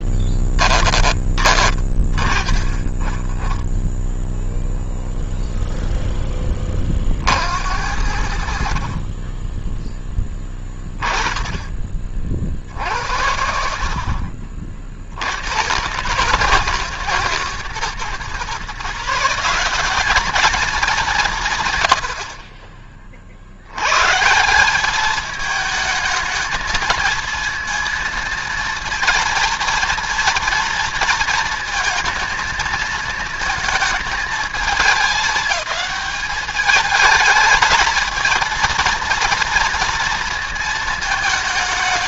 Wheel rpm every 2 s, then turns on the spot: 10, 30, 0, 20, 60, 20, 60, 50, 130, 150, 210, 50, 190, 220, 230, 230, 230, 200, 210, 230, 220.
22-24